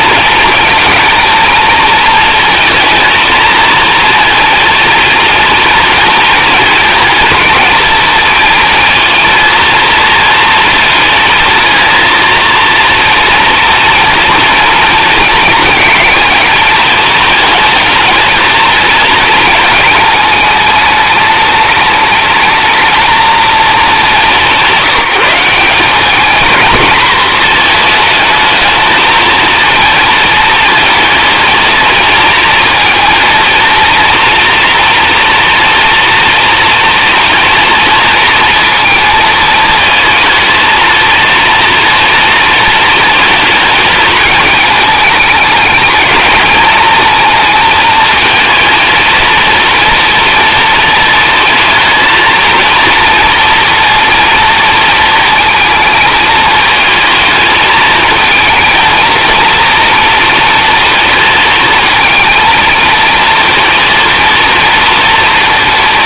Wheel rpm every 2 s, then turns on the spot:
220, 230, 230, 230, 230, 230, 230, 230, 230, 230, 210, 220, 190, 220, 220, 220, 230, 230, 230, 220, 220, 220, 210, 220, 230, 230, 230, 230, 220, 230, 230, 230, 230.
none